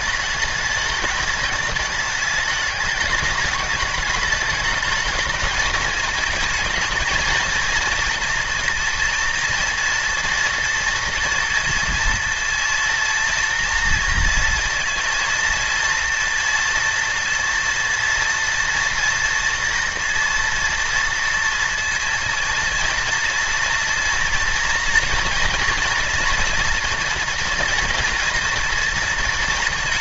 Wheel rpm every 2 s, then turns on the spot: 210, 210, 220, 220, 230, 230, 230, 230, 230, 230, 230, 230, 230, 230, 230.
none